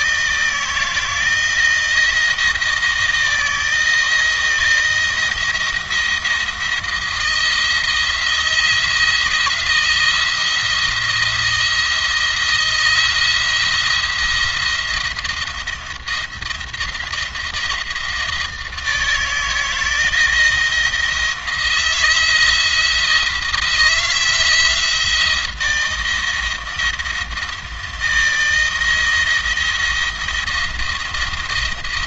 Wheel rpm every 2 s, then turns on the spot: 160, 170, 160, 170, 170, 170, 170, 170, 170, 160, 170, 160, 170, 170, 160, 170.
none